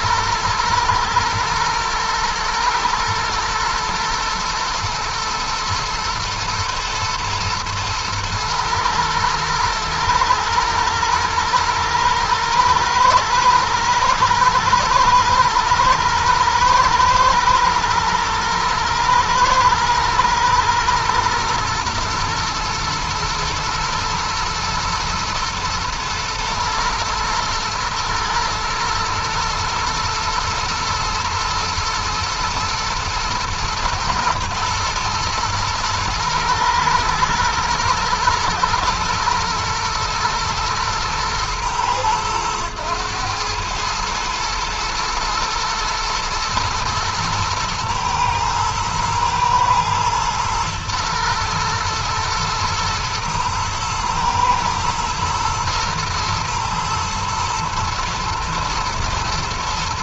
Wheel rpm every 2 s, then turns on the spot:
120, 120, 110, 120, 110, 110, 110, 120, 120, 110, 120, 110, 120, 120, 120, 110, 120, 120, 120, 120, 110, 110, 120, 110, 110, 110, 120, 110, 110, 110.
none